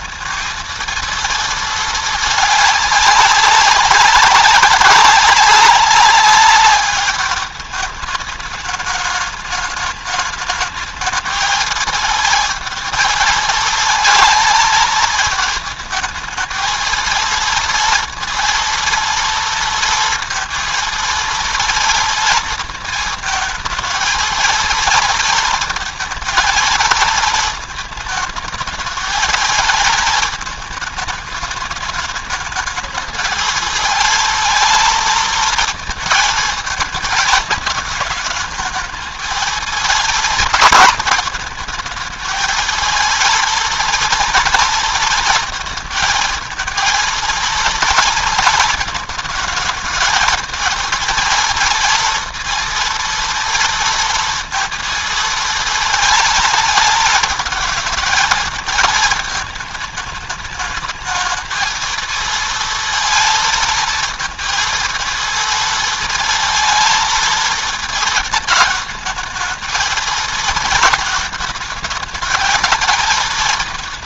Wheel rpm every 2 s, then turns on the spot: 230, 210, 200, 210, 210, 220, 220, 220, 230, 230, 230, 220, 220, 220, 220, 220, 220, 230, 220, 220, 220, 220, 220, 220, 220, 230, 230, 220, 220, 220, 220, 230, 230, 230, 220, 220, 220.
none